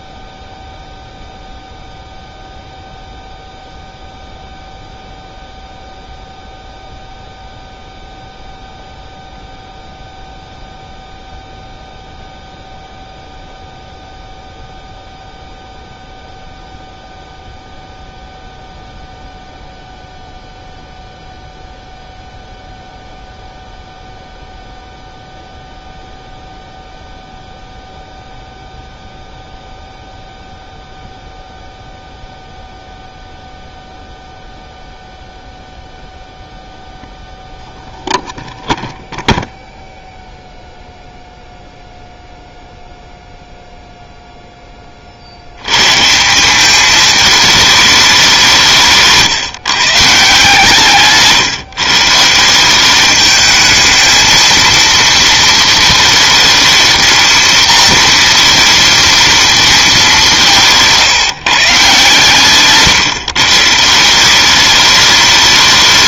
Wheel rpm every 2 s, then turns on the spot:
0, 0, 0, 0, 0, 0, 0, 0, 0, 0, 0, 0, 0, 0, 0, 0, 0, 0, 0, 0, 0, 0, 20, 200, 170, 150, 190, 230, 230, 230, 170, 140, 200.
none